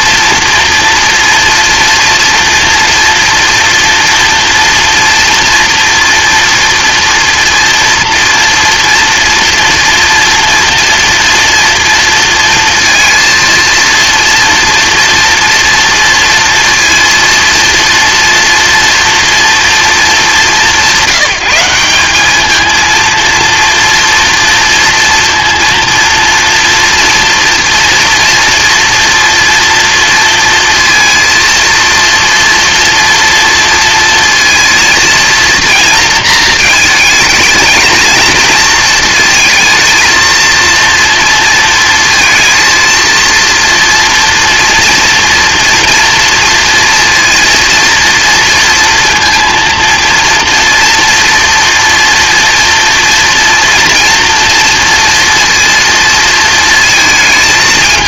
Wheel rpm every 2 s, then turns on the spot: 230, 240, 230, 230, 230, 230, 230, 230, 230, 230, 200, 220, 230, 230, 230, 230, 230, 230, 230, 230, 230, 230, 230, 230, 230, 230, 240, 230, 230.
none